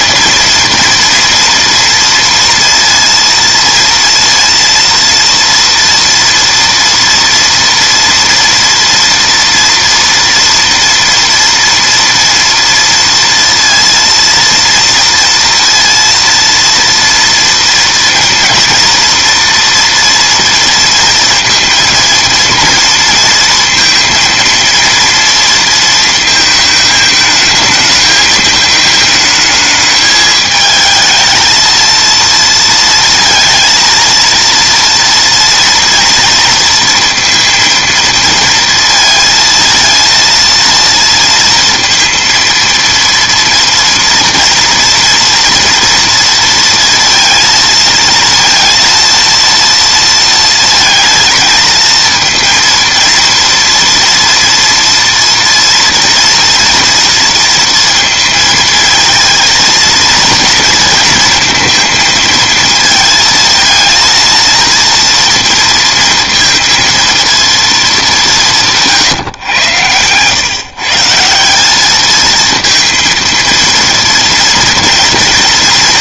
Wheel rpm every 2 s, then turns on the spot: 230, 230, 230, 240, 230, 230, 230, 230, 230, 230, 230, 230, 230, 220, 220, 220, 230, 230, 230, 230, 230, 230, 230, 230, 230, 220, 230, 230, 230, 230, 230, 230, 230, 230, 160, 140, 230, 230.
none